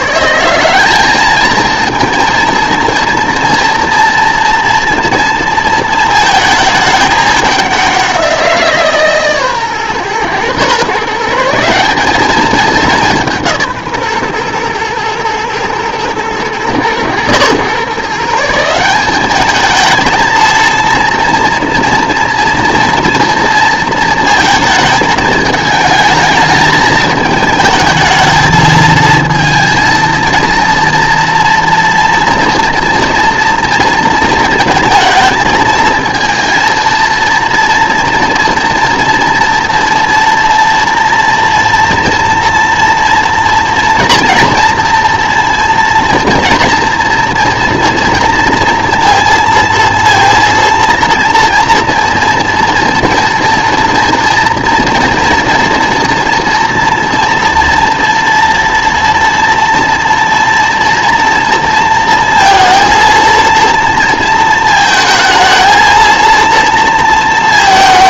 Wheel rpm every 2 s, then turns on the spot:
190, 230, 230, 220, 160, 130, 200, 120, 110, 180, 230, 230, 220, 220, 220, 230, 230, 230, 230, 230, 230, 230, 240, 240, 230, 230, 230, 230, 230, 230, 230, 230, 220, 230.
none